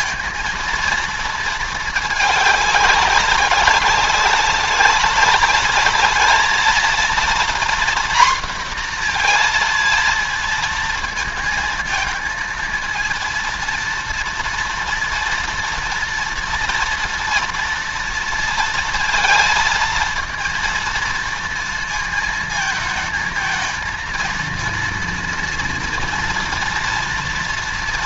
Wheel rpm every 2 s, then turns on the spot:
230, 210, 200, 220, 240, 230, 220, 230, 230, 230, 230, 230, 230, 240.
none